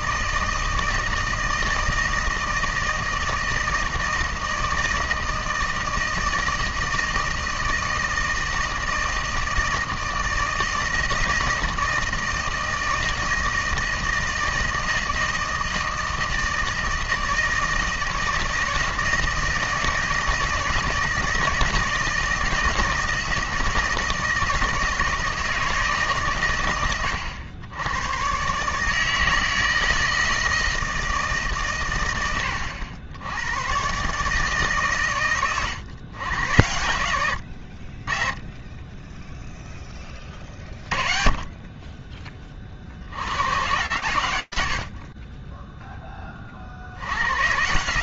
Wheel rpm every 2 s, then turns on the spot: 160, 160, 160, 160, 160, 160, 160, 160, 160, 160, 170, 160, 160, 120, 130, 160, 110, 150, 110, 20, 40, 40, 60, 50.
none